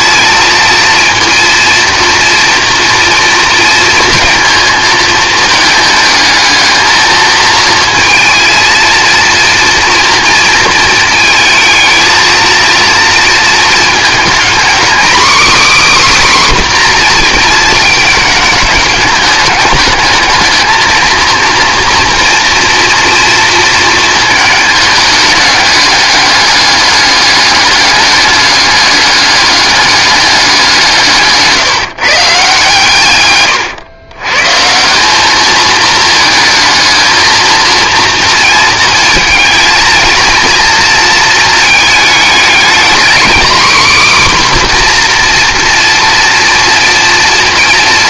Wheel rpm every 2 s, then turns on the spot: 230, 230, 230, 220, 230, 220, 230, 240, 260, 210, 220, 230, 210, 210, 210, 180, 150, 160, 220, 220, 230, 220, 260, 230.
none